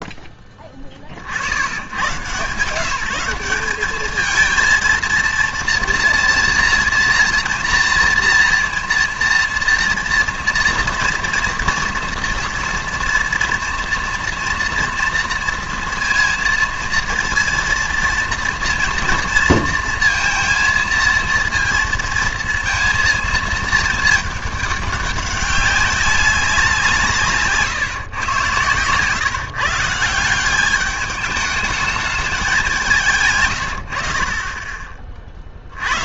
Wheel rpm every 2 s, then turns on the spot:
20, 160, 220, 230, 230, 240, 230, 230, 230, 230, 230, 230, 210, 180, 120, 190, 190, 30.
none